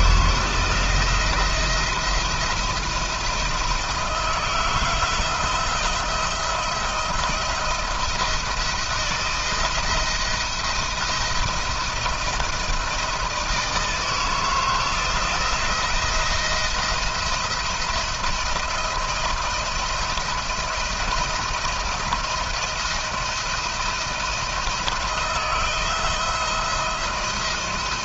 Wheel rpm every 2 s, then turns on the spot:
170, 170, 160, 170, 170, 170, 170, 160, 170, 170, 170, 170, 170, 170.
none